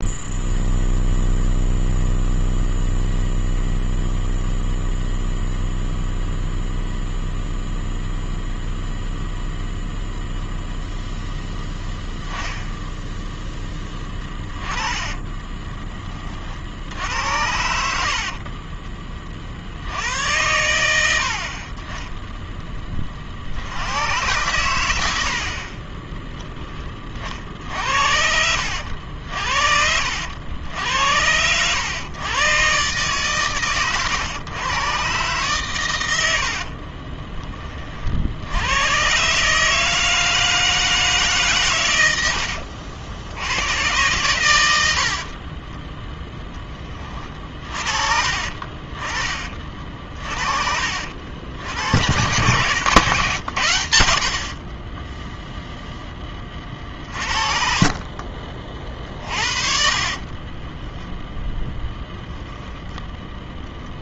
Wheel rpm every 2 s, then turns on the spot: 0, 0, 0, 0, 0, 0, 10, 20, 60, 40, 90, 10, 110, 20, 70, 80, 130, 110, 60, 80, 160, 70, 90, 10, 30, 50, 120, 30, 30, 40, 20, 0.
14-16 52-54 60-62